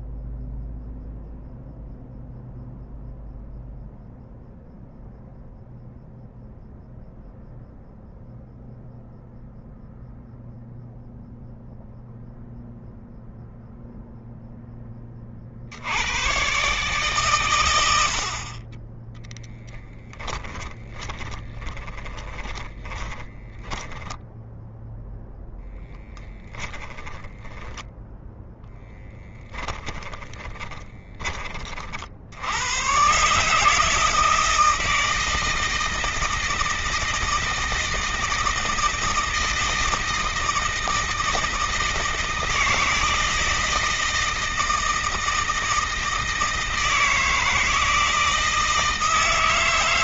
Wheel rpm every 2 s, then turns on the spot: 0, 0, 0, 0, 0, 0, 0, 10, 130, 30, 10, 10, 0, 10, 10, 30, 130, 160, 160, 160, 160, 160, 160, 160, 160.
20-24 26-32